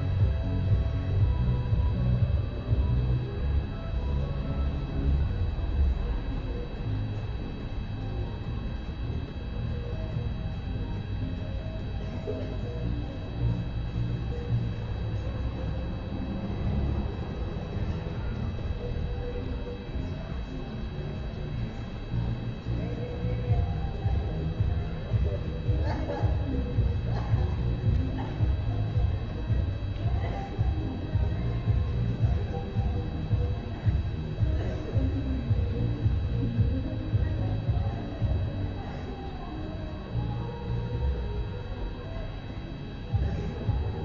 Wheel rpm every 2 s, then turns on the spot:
0, 0, 0, 0, 0, 0, 0, 0, 0, 0, 0, 0, 0, 0, 0, 0, 0, 0, 0, 0, 0, 0.
none